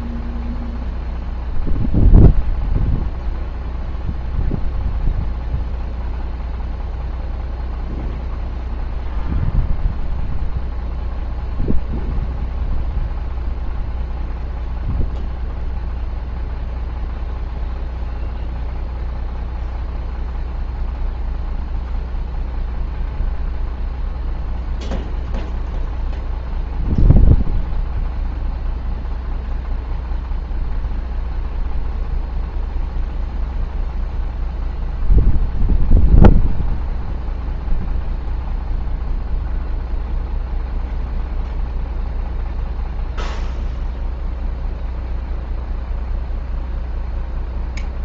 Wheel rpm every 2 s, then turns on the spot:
0, 0, 0, 0, 0, 0, 0, 0, 0, 0, 0, 0, 0, 0, 0, 0, 0, 0, 0, 0, 0, 0, 0, 0.
none